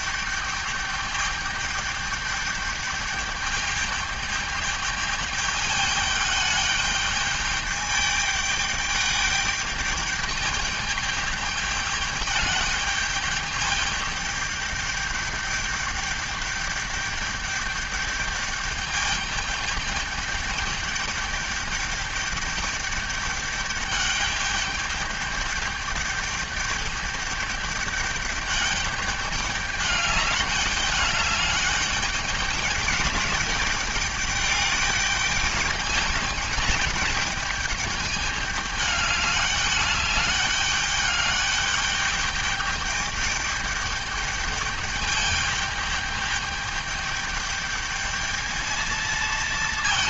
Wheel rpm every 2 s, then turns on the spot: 210, 210, 210, 210, 210, 210, 210, 210, 210, 210, 210, 210, 210, 210, 200, 200, 210, 210, 210, 210, 200, 210, 210, 210, 220.
none